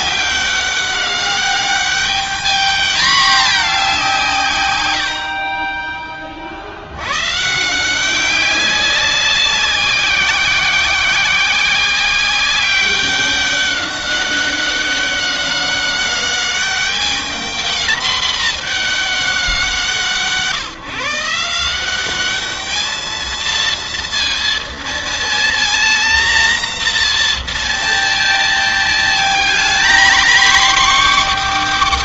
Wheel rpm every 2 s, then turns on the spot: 190, 210, 150, 40, 190, 180, 190, 190, 200, 220, 150, 200, 230, 240, 230, 250.
none